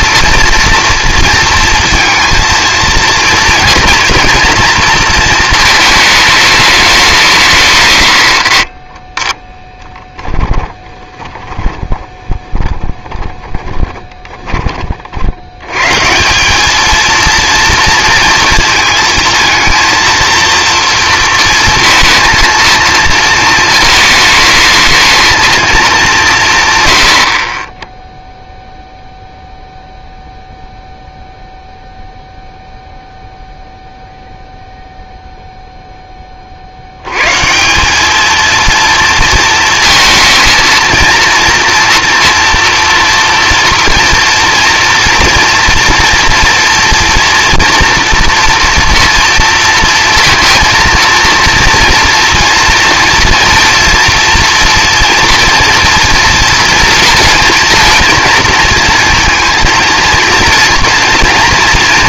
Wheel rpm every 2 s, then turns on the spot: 240, 230, 230, 210, 50, 20, 20, 20, 200, 230, 230, 230, 220, 160, 0, 0, 0, 0, 40, 230, 220, 240, 230, 230, 230, 230, 230, 230, 230, 230, 230.
10-14